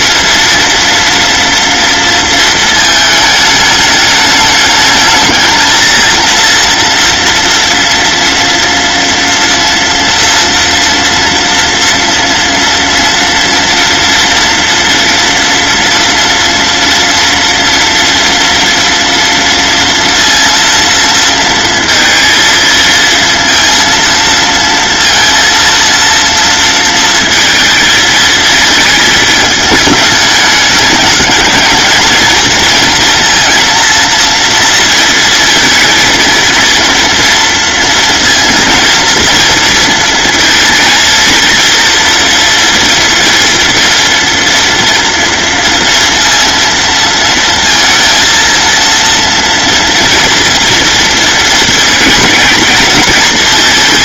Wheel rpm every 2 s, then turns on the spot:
230, 220, 220, 240, 230, 230, 230, 230, 240, 230, 230, 230, 230, 230, 220, 210, 230, 230, 230, 230, 230, 230, 240, 230, 230, 230, 230.
none